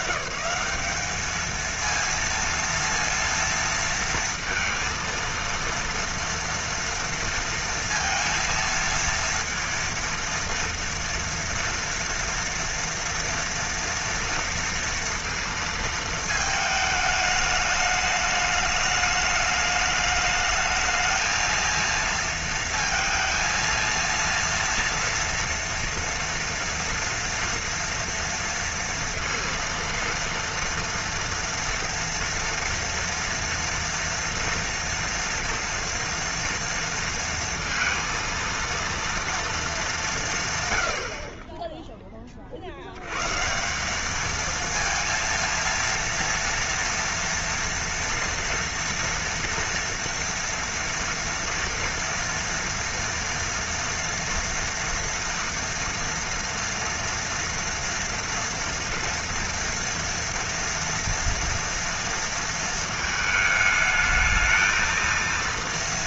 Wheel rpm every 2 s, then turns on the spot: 160, 230, 230, 230, 230, 230, 230, 230, 220, 210, 220, 230, 230, 230, 230, 230, 230, 230, 230, 230, 130, 40, 220, 230, 230, 230, 230, 230, 230, 230, 230, 230, 220.
none